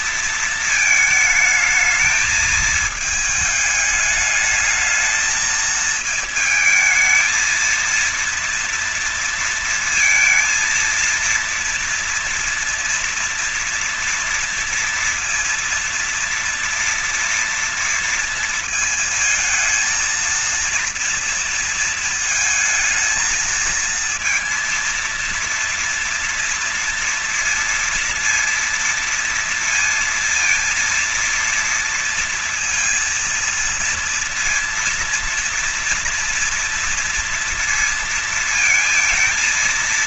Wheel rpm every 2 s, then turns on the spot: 230, 220, 210, 220, 230, 230, 240, 230, 230, 230, 230, 220, 230, 230, 230, 230, 230, 230, 230, 230.
none